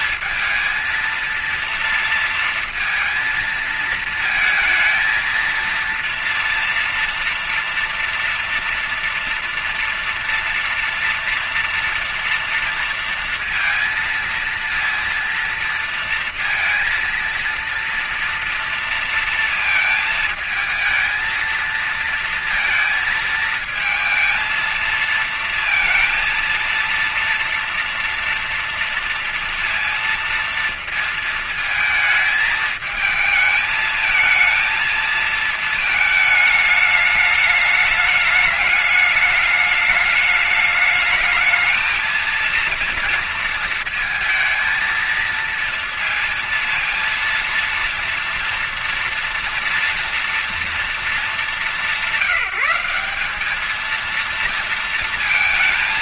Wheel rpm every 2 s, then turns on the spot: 230, 230, 220, 230, 230, 230, 230, 230, 230, 230, 220, 230, 220, 230, 230, 230, 220, 230, 210, 210, 210, 230, 230, 230, 230, 220, 180, 230.
none